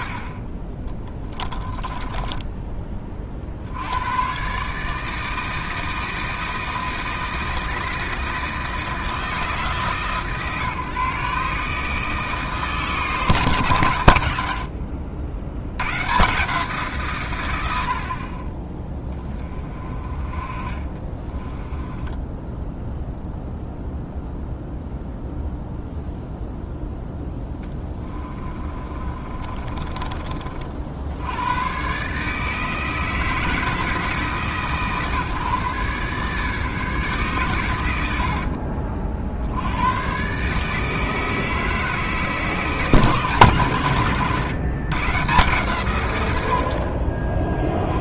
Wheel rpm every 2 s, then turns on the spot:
20, 20, 150, 160, 160, 140, 150, 60, 150, 10, 30, 0, 0, 0, 30, 60, 160, 150, 150, 50, 150, 160, 130, 50.
0-2 20-22 28-30